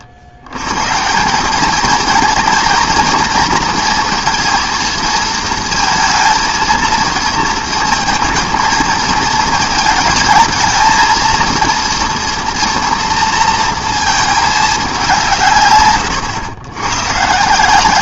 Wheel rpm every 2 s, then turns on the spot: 110, 230, 230, 230, 230, 220, 240, 200, 110.
none